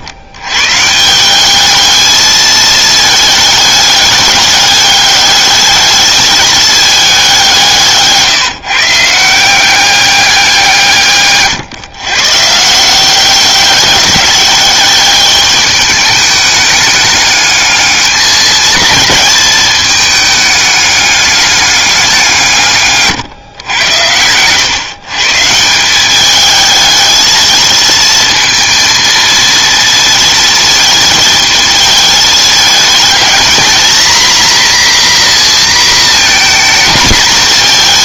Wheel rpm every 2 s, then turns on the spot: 140, 220, 200, 210, 150, 170, 160, 200, 210, 220, 210, 150, 120, 220, 230, 220, 210, 240, 230.
none